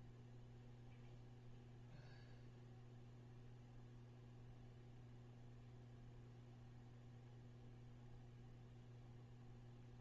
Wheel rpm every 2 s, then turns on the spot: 0, 0, 0, 0, 0.
none